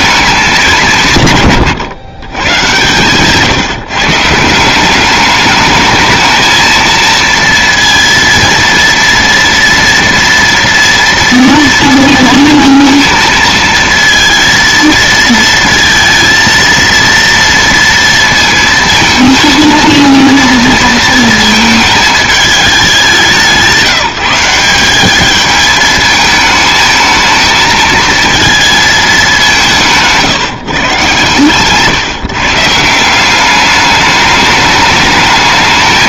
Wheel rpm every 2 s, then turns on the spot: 160, 130, 200, 230, 230, 230, 230, 220, 230, 220, 230, 200, 200, 220, 220, 140, 170, 210.
none